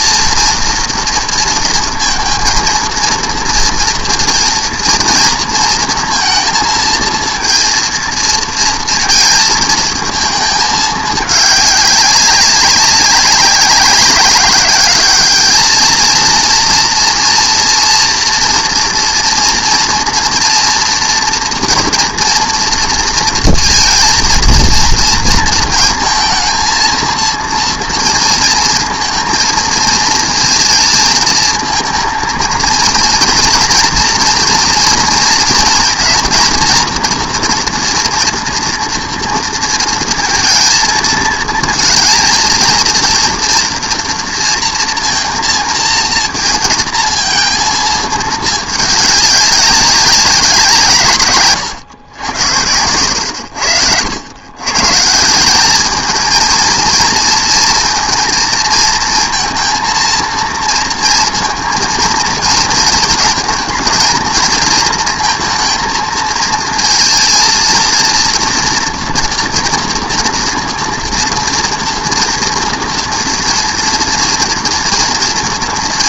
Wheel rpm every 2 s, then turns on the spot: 230, 240, 230, 230, 220, 210, 190, 220, 240, 230, 230, 230, 230, 230, 220, 220, 230, 230, 240, 230, 230, 230, 230, 230, 190, 120, 70, 200, 230, 230, 230, 220, 230, 230, 240, 230, 230, 230.
none